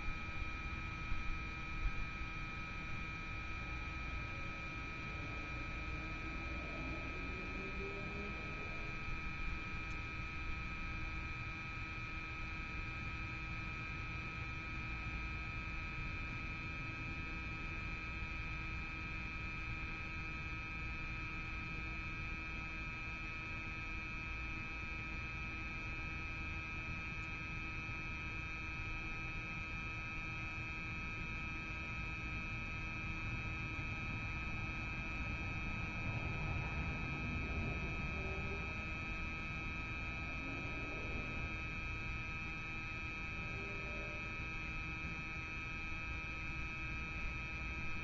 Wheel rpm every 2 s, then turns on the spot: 0, 0, 0, 0, 0, 0, 0, 0, 0, 0, 0, 0, 0, 0, 0, 0, 0, 0, 0, 0, 0, 0, 0, 0.
none